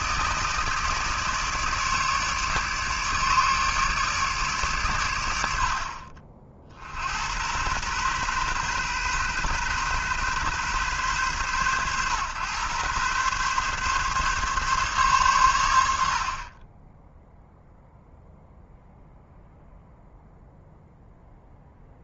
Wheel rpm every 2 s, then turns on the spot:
150, 150, 130, 60, 130, 130, 120, 140, 20, 0, 0.
none